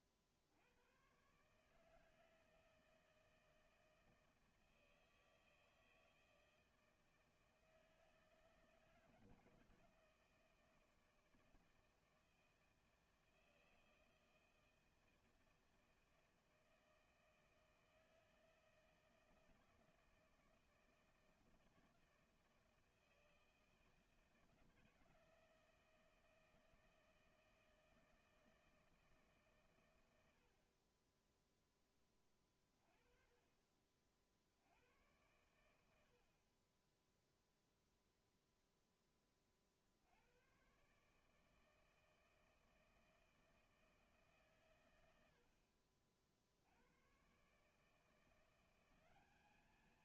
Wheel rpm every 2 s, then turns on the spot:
60, 160, 160, 160, 160, 160, 160, 160, 160, 160, 160, 160, 160, 160, 160, 70, 20, 50, 50, 0, 90, 160, 150, 50, 170.
none